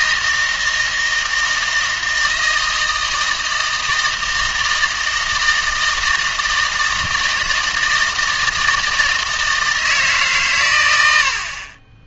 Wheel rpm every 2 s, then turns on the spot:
160, 160, 160, 160, 160, 100.
none